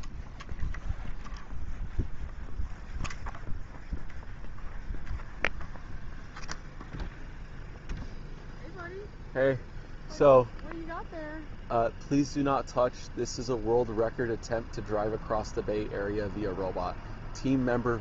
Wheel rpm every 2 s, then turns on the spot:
0, 0, 0, 0, 0, 0, 0, 0, 0.
none